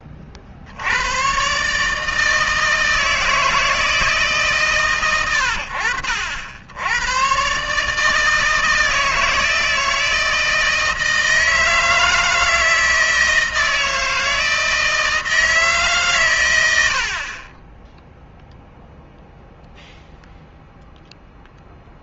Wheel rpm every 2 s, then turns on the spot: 70, 160, 150, 90, 160, 160, 160, 160, 110, 0, 0.
none